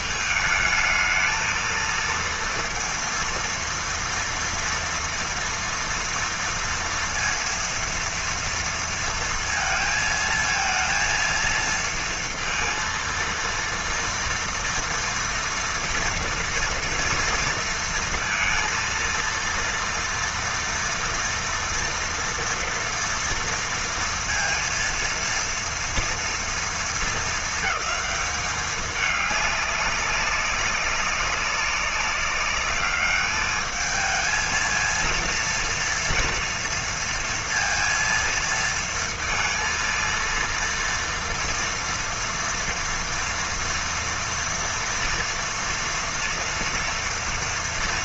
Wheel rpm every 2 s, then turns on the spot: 220, 230, 230, 230, 230, 230, 230, 230, 230, 230, 230, 230, 230, 220, 210, 200, 210, 230, 230, 230, 230, 230, 230, 230.
none